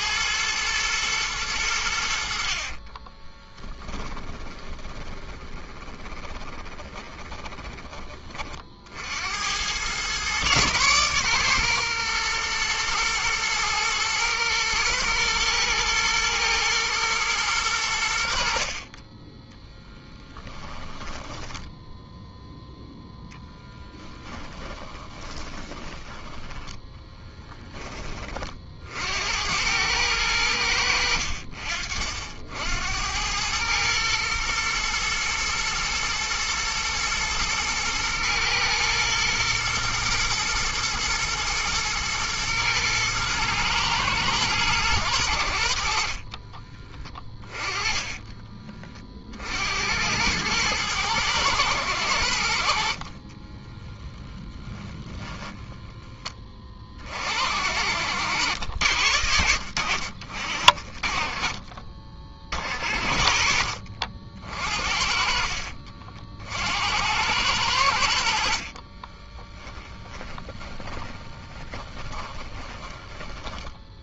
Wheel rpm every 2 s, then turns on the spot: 110, 40, 20, 20, 60, 130, 110, 120, 110, 30, 10, 0, 20, 20, 60, 80, 80, 120, 110, 120, 120, 110, 110, 40, 40, 110, 60, 20, 40, 80, 40, 50, 60, 80, 50, 20, 20.
2-8 20-22 24-28 46-48 52-56 68-74